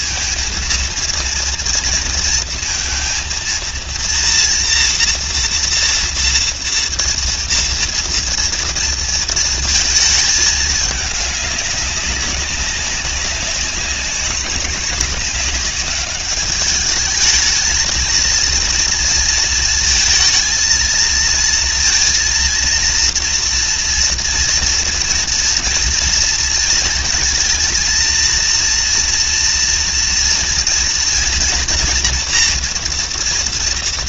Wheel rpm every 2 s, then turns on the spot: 230, 230, 230, 230, 230, 210, 190, 200, 200, 230, 230, 230, 230, 230, 230, 230, 230.
none